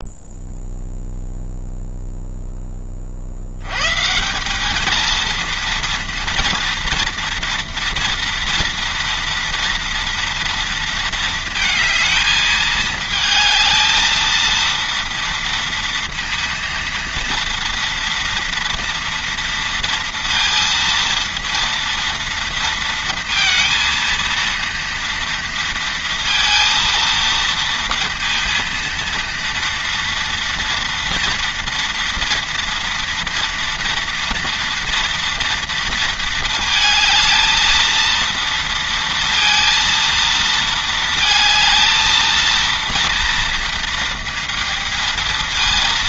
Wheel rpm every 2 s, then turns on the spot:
0, 50, 220, 230, 230, 230, 220, 230, 230, 230, 230, 230, 230, 230, 230, 230, 230, 240, 220, 230, 220, 230, 230.
none